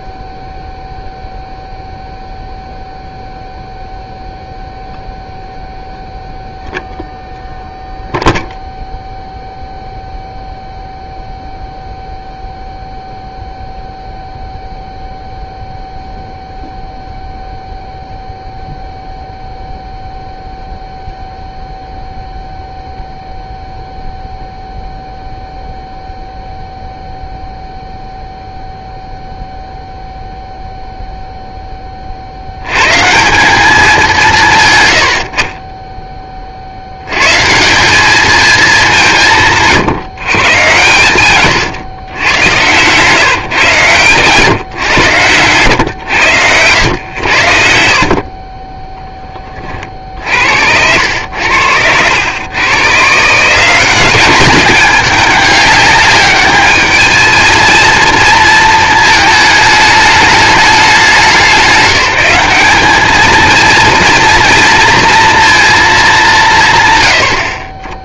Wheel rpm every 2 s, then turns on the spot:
0, 0, 0, 0, 0, 0, 0, 0, 0, 0, 0, 0, 0, 0, 0, 0, 100, 120, 60, 200, 110, 110, 130, 100, 20, 70, 120, 210, 210, 230, 200, 200, 230, 150.
42-44 48-50